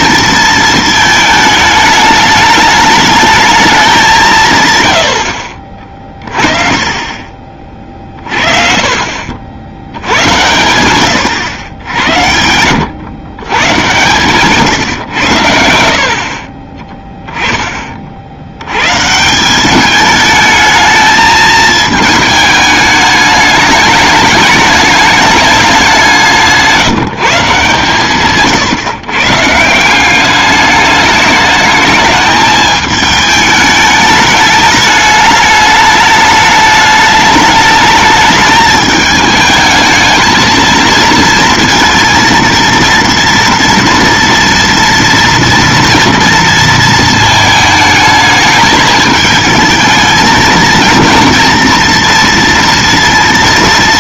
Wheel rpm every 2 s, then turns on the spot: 220, 210, 100, 30, 40, 90, 100, 140, 30, 80, 210, 210, 210, 160, 130, 200, 210, 210, 210, 210, 220, 230, 230, 230, 220, 230, 230.
6-8